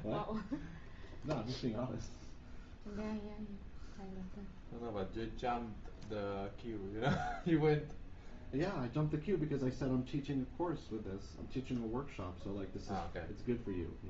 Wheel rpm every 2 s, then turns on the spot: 0, 0, 0, 0, 0, 0, 0.
none